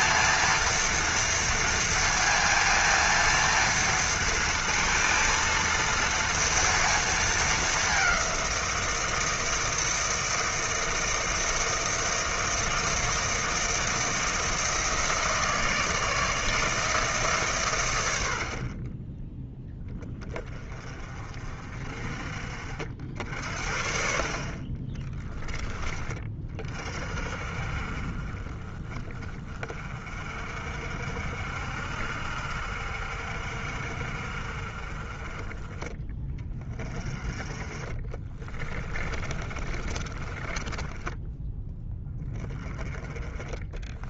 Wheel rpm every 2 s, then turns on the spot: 230, 230, 230, 230, 170, 160, 160, 160, 160, 30, 30, 60, 30, 40, 30, 50, 60, 30, 20, 20, 10, 20.
24-26 38-42